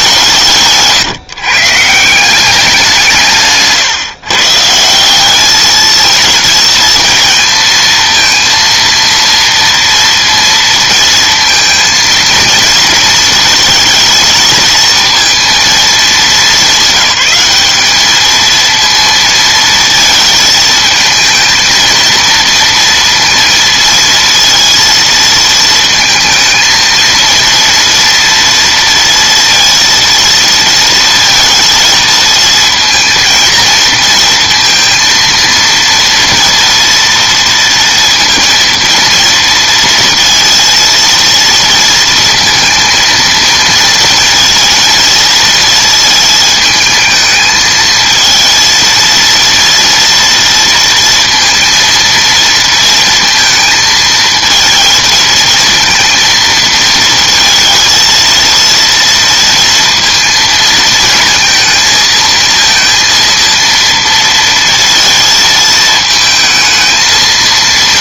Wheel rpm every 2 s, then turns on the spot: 150, 180, 160, 230, 230, 230, 230, 220, 200, 230, 220, 230, 230, 230, 230, 230, 230, 230, 230, 230, 230, 230, 230, 220, 230, 230, 230, 230, 230, 230, 230, 230, 230, 220.
none